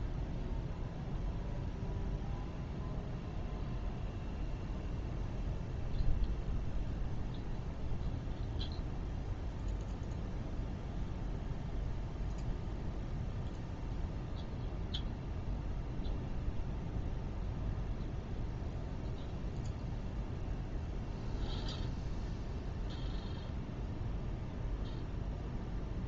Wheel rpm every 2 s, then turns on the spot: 0, 0, 0, 0, 0, 0, 0, 0, 0, 0, 0, 0, 0.
none